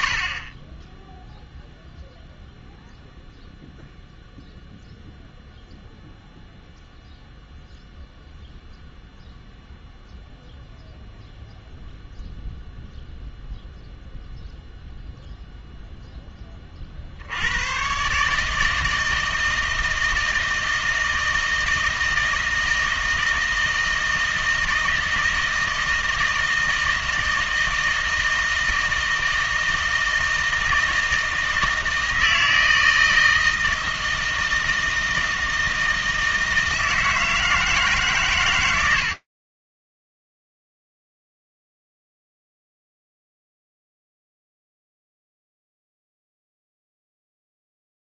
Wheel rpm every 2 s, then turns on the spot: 10, 0, 0, 0, 0, 0, 0, 0, 40, 160, 160, 160, 160, 160, 160, 160, 160, 160, 160, 80, 0, 0, 10, 10.
none